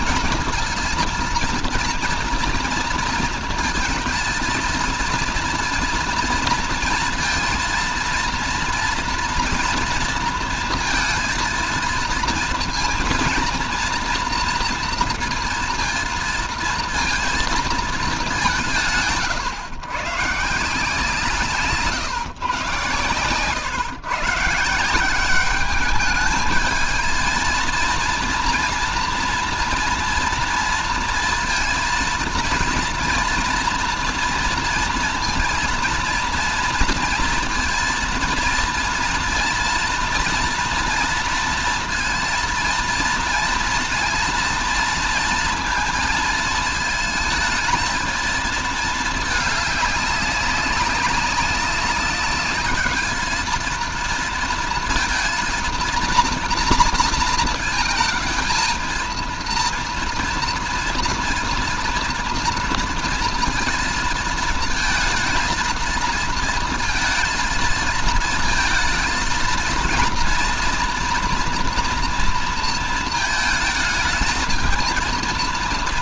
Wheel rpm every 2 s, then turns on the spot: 230, 230, 230, 230, 230, 230, 230, 230, 230, 160, 160, 120, 170, 220, 230, 230, 230, 230, 230, 230, 230, 230, 230, 220, 220, 200, 210, 230, 230, 230, 230, 230, 220, 230, 230, 230, 220, 220.
none